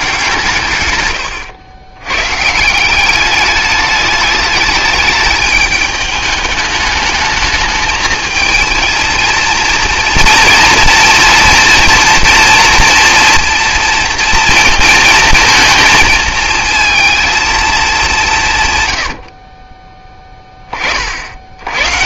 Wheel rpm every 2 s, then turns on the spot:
130, 180, 210, 210, 220, 230, 240, 230, 220, 130, 30.
18-20